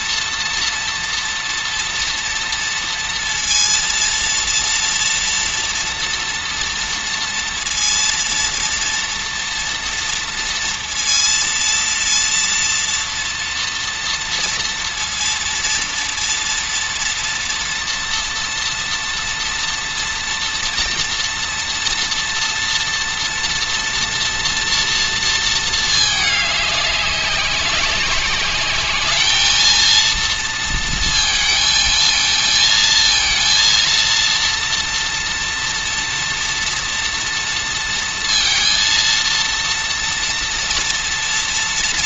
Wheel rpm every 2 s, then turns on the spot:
230, 230, 230, 240, 230, 230, 230, 230, 230, 230, 230, 230, 230, 200, 200, 230, 220, 230, 230, 230, 230.
none